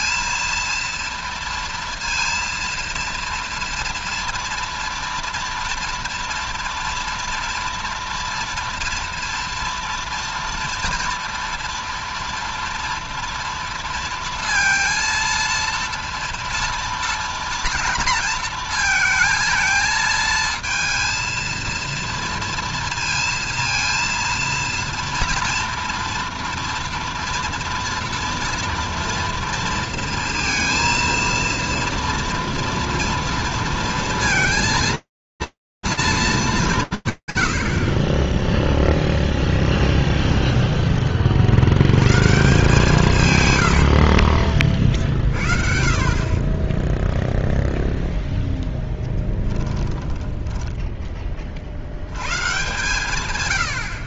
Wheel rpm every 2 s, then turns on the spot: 230, 230, 230, 230, 230, 230, 230, 230, 230, 230, 220, 230, 230, 230, 230, 230, 230, 230, 40, 0, 90, 90, 50, 0, 20, 30, 110.
42-44 48-50